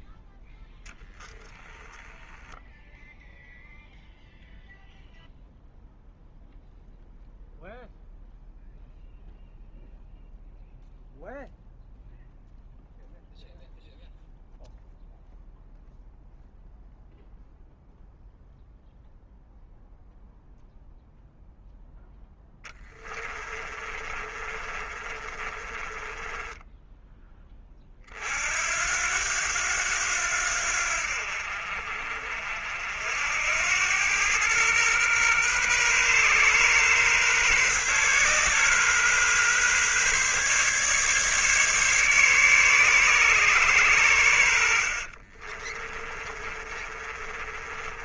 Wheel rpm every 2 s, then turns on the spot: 10, 10, 0, 0, 0, 0, 0, 0, 0, 0, 0, 10, 30, 10, 70, 80, 60, 110, 130, 130, 140, 140, 70, 30.
0-2 22-28 44-48